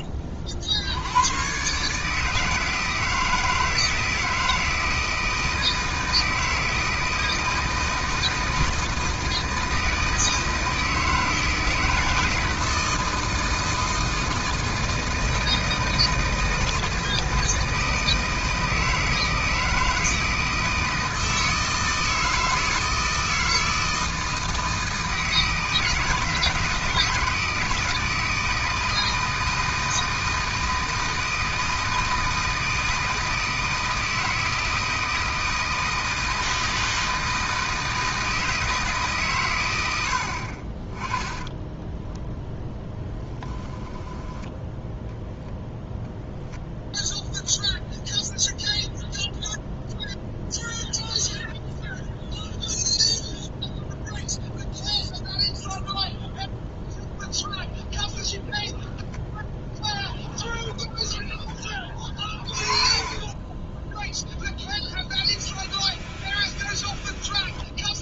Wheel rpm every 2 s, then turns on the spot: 80, 160, 160, 160, 160, 160, 160, 160, 160, 160, 160, 160, 160, 160, 160, 160, 160, 160, 160, 150, 30, 10, 10, 0, 0, 0, 0, 0, 0, 0, 10, 20, 0, 0.
62-64